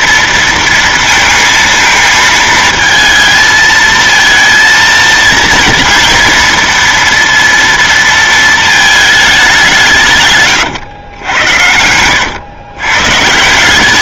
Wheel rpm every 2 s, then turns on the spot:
230, 220, 230, 230, 230, 140, 110.
none